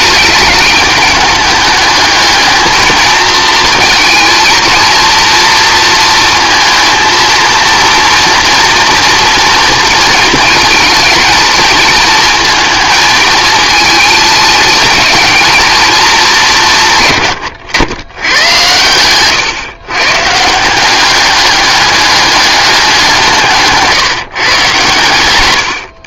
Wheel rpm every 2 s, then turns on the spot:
210, 220, 230, 230, 240, 230, 220, 220, 150, 110, 190, 190, 130.
none